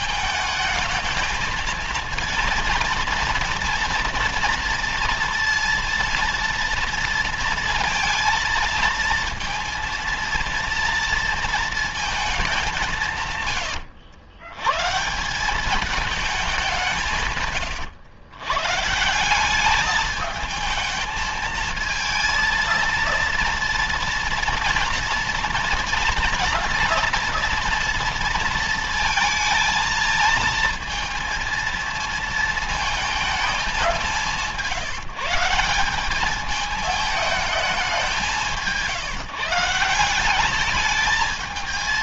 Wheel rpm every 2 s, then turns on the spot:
220, 230, 230, 230, 230, 230, 190, 110, 200, 130, 220, 230, 230, 240, 230, 230, 220, 170, 210, 190, 200.
none